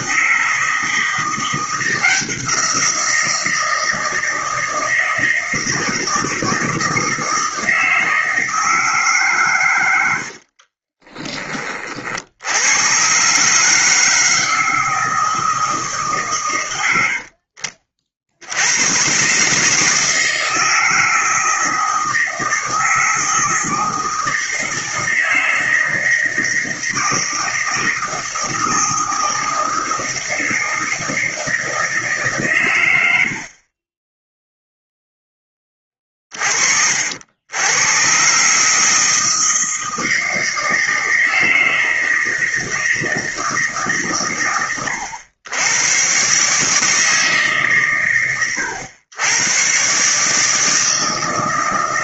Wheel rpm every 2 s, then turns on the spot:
160, 170, 170, 160, 160, 40, 100, 160, 100, 100, 160, 160, 160, 160, 160, 160, 110, 0, 60, 150, 160, 160, 110, 140, 100, 160.
10-12